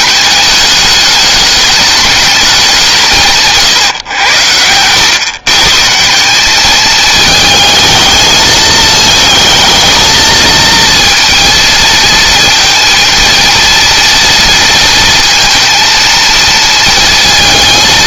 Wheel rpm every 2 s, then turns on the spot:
210, 180, 100, 210, 220, 230, 230, 230, 230.
none